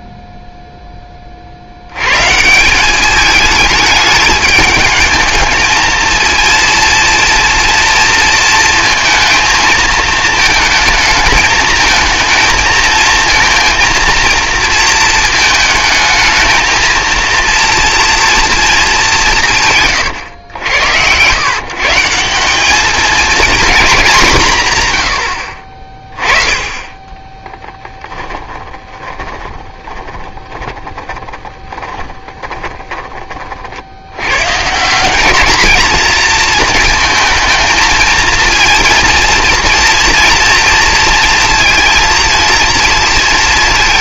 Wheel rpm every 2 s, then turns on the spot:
0, 180, 210, 230, 230, 220, 220, 230, 220, 220, 100, 200, 140, 30, 10, 20, 30, 150, 230, 230, 230, 230.
28-34